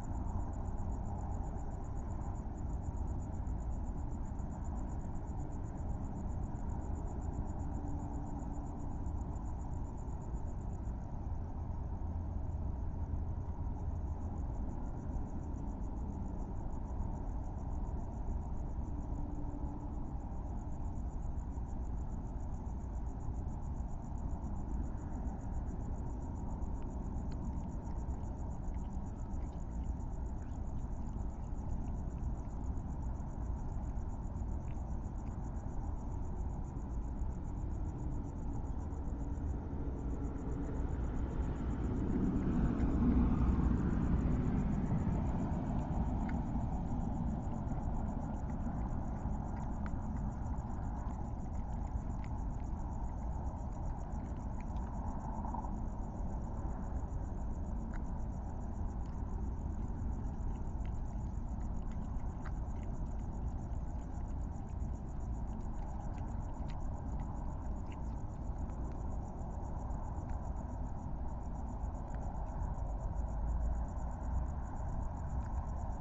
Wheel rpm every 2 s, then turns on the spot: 0, 0, 0, 0, 0, 0, 0, 0, 0, 0, 0, 0, 0, 0, 0, 0, 0, 0, 0, 0, 0, 0, 0, 0, 0, 0, 0, 0, 0, 0, 0, 0, 0, 0, 0, 0, 0, 0.
none